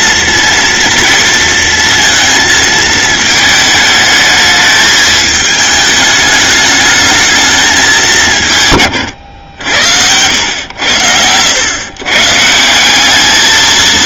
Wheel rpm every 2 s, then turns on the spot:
230, 220, 220, 210, 160, 100, 160.
none